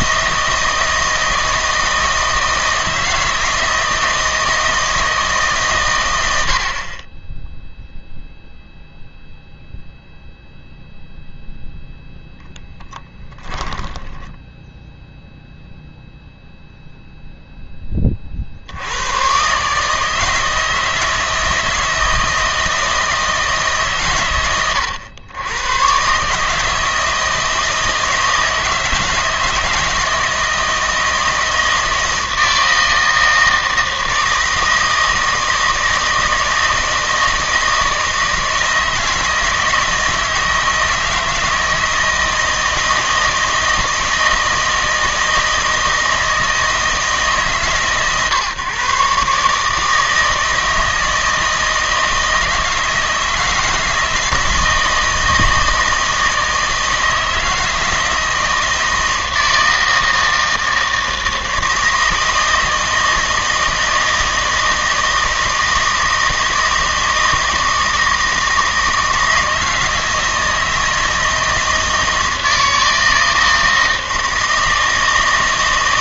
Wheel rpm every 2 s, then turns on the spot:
160, 160, 160, 70, 0, 0, 10, 10, 0, 60, 160, 160, 110, 160, 160, 160, 160, 160, 160, 160, 160, 160, 160, 160, 130, 160, 160, 160, 160, 160, 160, 160, 160, 160, 160, 160, 160, 160.
14-16